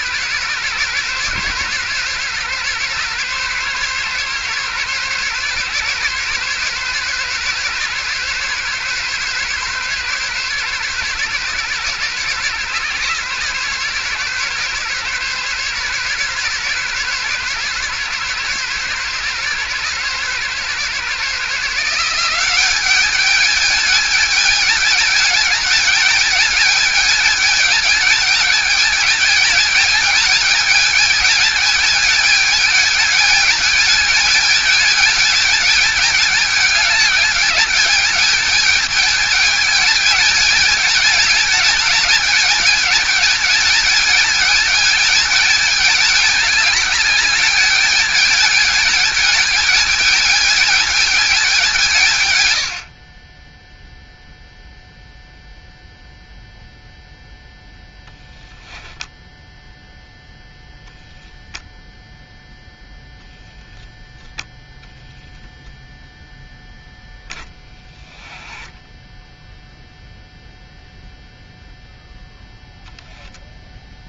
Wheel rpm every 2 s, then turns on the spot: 130, 140, 130, 130, 140, 140, 140, 140, 140, 140, 140, 190, 210, 220, 210, 210, 210, 220, 210, 210, 220, 210, 220, 210, 210, 210, 100, 0, 0, 10, 0, 0, 0, 10, 10, 0, 0.
68-70